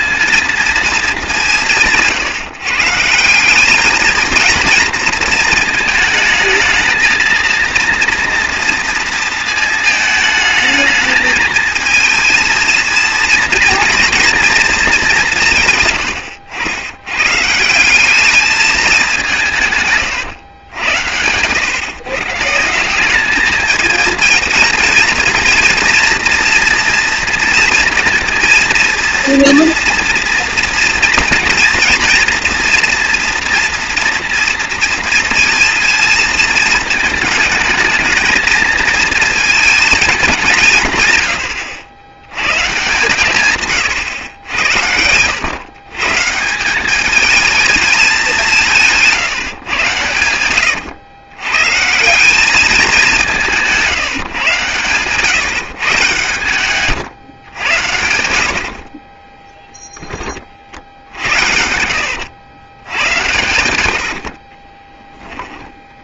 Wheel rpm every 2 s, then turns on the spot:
230, 150, 230, 230, 230, 220, 230, 220, 80, 210, 90, 160, 230, 230, 230, 230, 230, 230, 220, 230, 180, 130, 90, 180, 180, 110, 200, 130, 130, 60, 50, 90, 30.
50-52 56-58 64-66